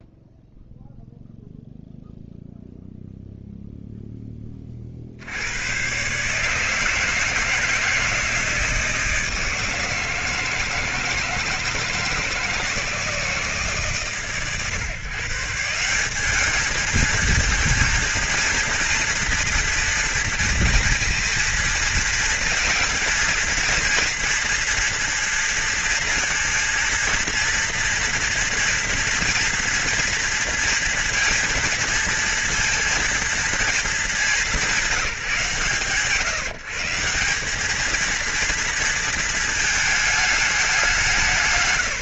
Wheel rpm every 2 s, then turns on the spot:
0, 0, 40, 160, 160, 160, 160, 130, 210, 230, 230, 230, 230, 230, 230, 230, 230, 200, 150, 230, 200.
none